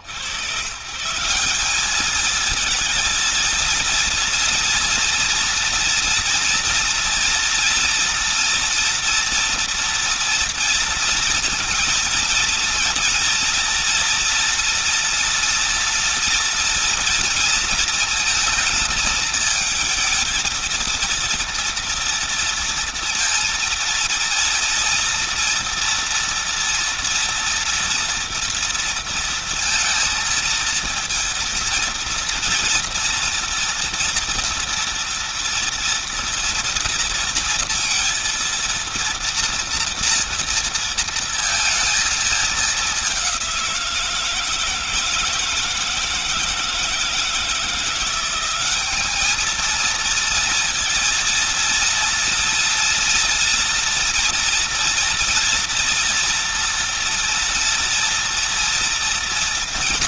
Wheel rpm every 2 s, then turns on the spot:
140, 230, 230, 230, 230, 230, 230, 230, 230, 220, 230, 230, 230, 230, 230, 230, 230, 230, 230, 230, 230, 210, 160, 160, 190, 230, 230, 230, 240, 240.
none